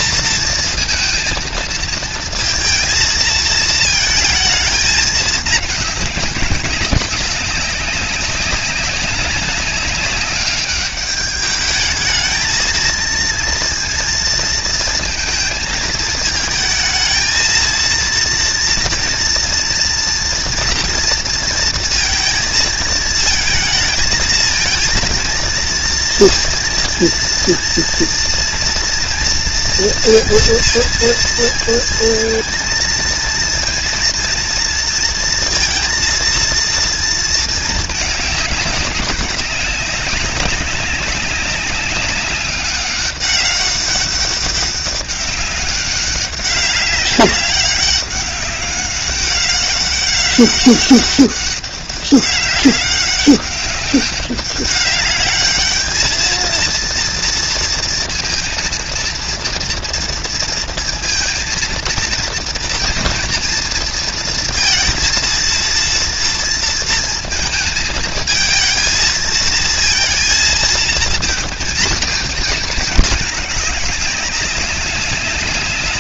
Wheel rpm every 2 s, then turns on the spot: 230, 230, 230, 210, 200, 190, 210, 230, 220, 230, 230, 230, 220, 230, 230, 230, 230, 230, 230, 230, 200, 200, 200, 200, 200, 190, 200, 200, 210, 230, 230, 230, 230, 230, 220, 220, 230, 210.
none